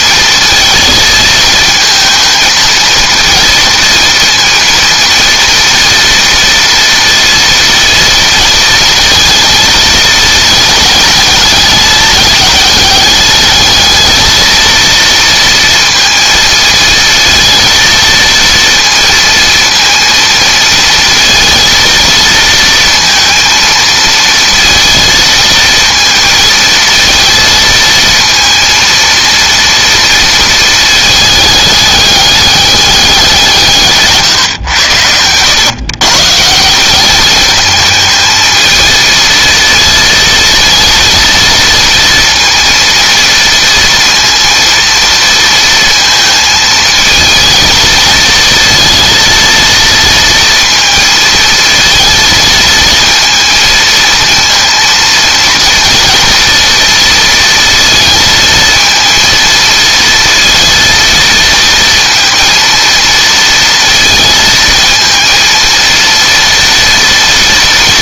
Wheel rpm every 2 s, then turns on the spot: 220, 220, 230, 230, 230, 220, 210, 230, 220, 230, 230, 230, 230, 230, 230, 220, 200, 110, 180, 220, 230, 230, 230, 220, 230, 230, 220, 230, 230, 230, 230, 230, 230, 230.
none